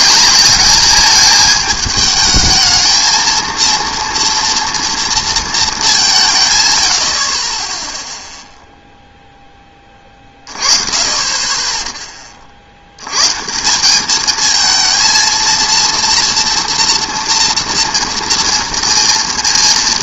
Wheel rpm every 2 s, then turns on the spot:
210, 220, 230, 130, 0, 30, 50, 220, 230, 230.
none